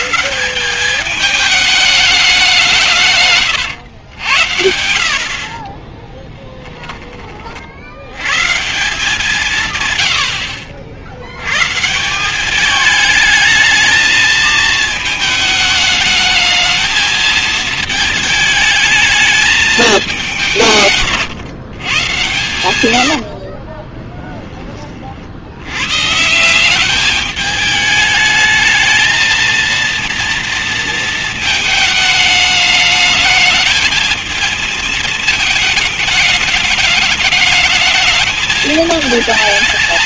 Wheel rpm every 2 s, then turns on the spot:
160, 200, 100, 10, 130, 100, 190, 220, 220, 220, 190, 120, 20, 160, 220, 230, 210, 220, 210, 210.
6-8